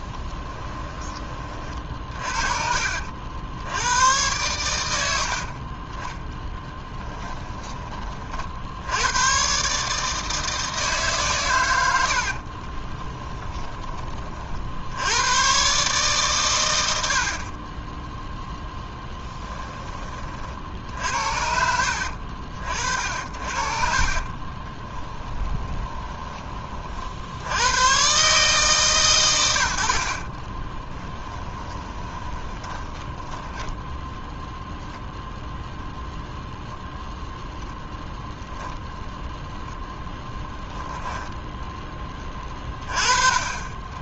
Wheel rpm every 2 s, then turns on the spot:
20, 50, 90, 10, 80, 150, 20, 80, 90, 10, 60, 60, 20, 50, 140, 20, 20, 10, 0, 0, 10, 30.
6-8 12-14 18-20 24-26 30-34 40-42